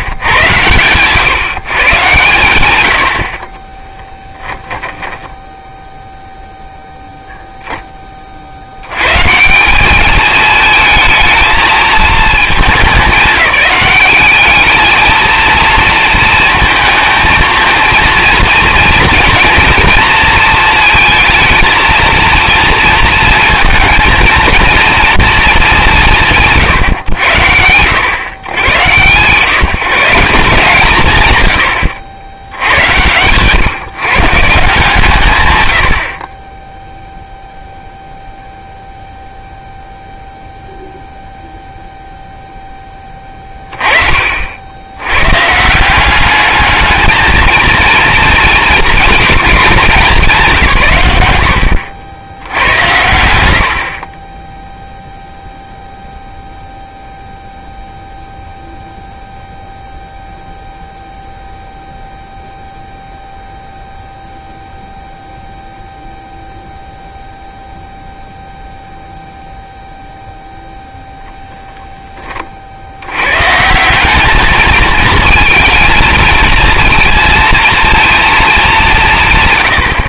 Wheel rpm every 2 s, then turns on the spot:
120, 120, 20, 0, 110, 220, 210, 220, 230, 230, 220, 230, 230, 100, 130, 130, 100, 150, 0, 0, 0, 20, 90, 220, 220, 140, 100, 0, 0, 0, 0, 0, 0, 0, 0, 0, 40, 210, 230, 210.
4-6